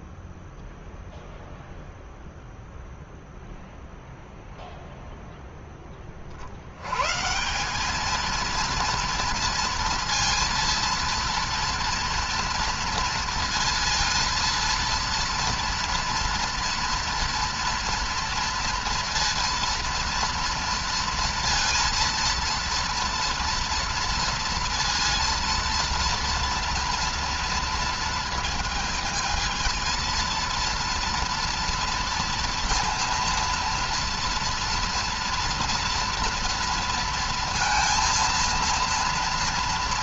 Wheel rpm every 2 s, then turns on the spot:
0, 0, 0, 90, 230, 230, 230, 230, 230, 230, 230, 230, 230, 230, 220, 230, 230, 230, 230, 230.
none